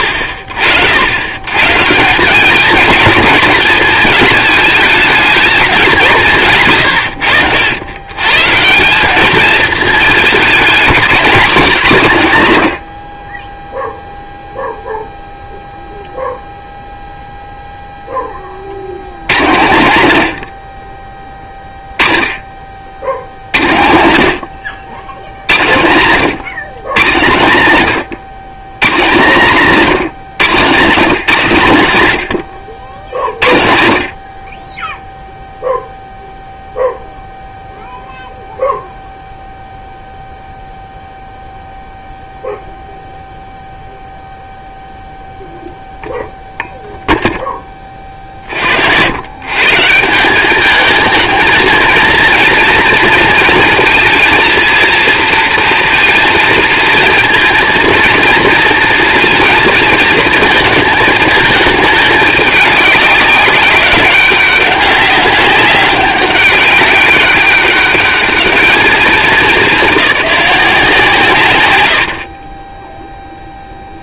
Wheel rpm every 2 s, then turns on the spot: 90, 220, 220, 150, 170, 200, 90, 0, 0, 60, 40, 50, 90, 150, 150, 170, 90, 10, 0, 0, 0, 0, 0, 0, 70, 210, 230, 230, 230, 230, 230, 200, 190, 200, 210, 170, 20.
none